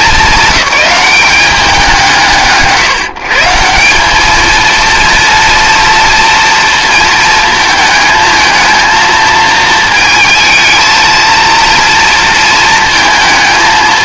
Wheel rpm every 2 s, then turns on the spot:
200, 150, 230, 230, 220, 220, 220.
none